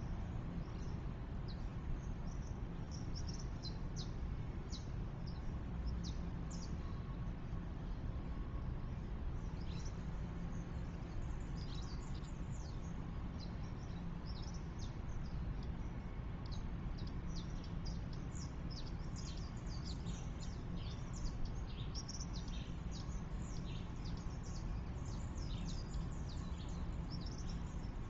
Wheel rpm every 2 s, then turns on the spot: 0, 0, 0, 0, 0, 0, 0, 0, 0, 0, 0, 0, 0, 0.
none